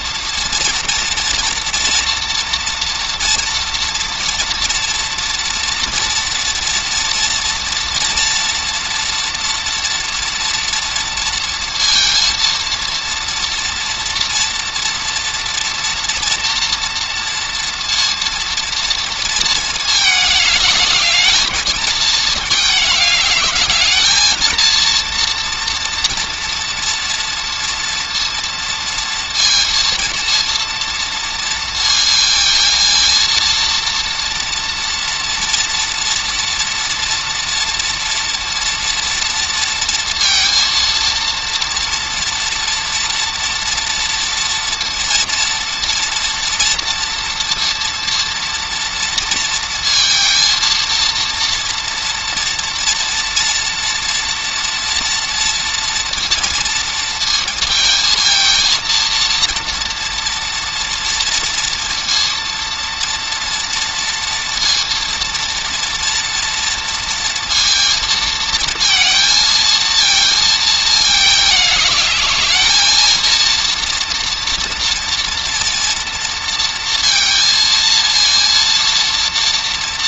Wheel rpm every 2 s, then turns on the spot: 230, 230, 230, 230, 230, 230, 240, 230, 230, 220, 220, 220, 230, 230, 230, 230, 230, 230, 230, 230, 230, 230, 230, 230, 230, 230, 230, 230, 230, 230, 230, 230, 240, 230, 230, 210, 230, 230, 230, 230.
none